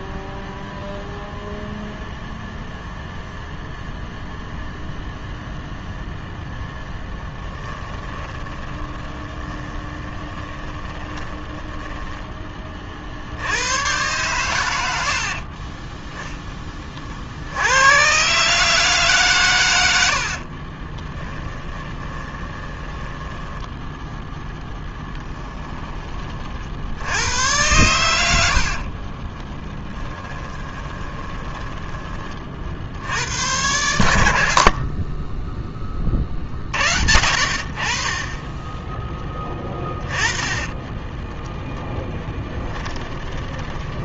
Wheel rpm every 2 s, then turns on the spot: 0, 0, 0, 10, 20, 10, 40, 80, 40, 150, 20, 20, 10, 90, 40, 20, 80, 40, 50, 10, 20, 10.
6-12 20-26 28-32 34-36 38-44